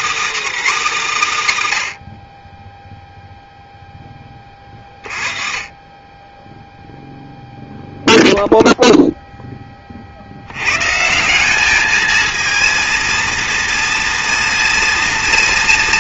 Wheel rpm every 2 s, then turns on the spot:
290, 20, 30, 0, 0, 110, 230, 230.
none